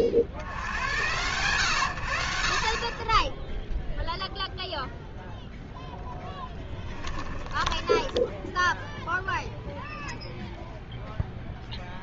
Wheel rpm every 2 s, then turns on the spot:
80, 60, 0, 10, 0, 0.
none